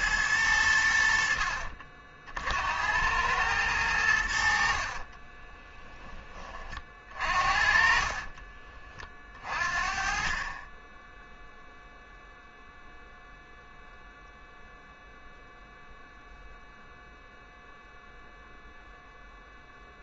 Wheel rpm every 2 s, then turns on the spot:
90, 80, 40, 40, 30, 20, 0, 0, 0, 0.
4-6 10-12